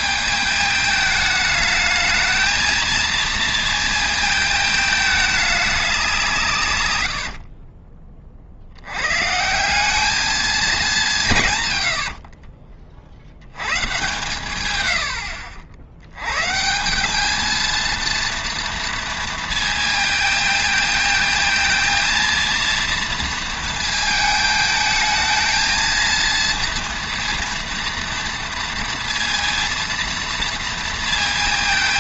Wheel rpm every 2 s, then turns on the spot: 210, 220, 220, 120, 70, 210, 40, 130, 150, 230, 220, 230, 220, 230, 230, 230.
12-14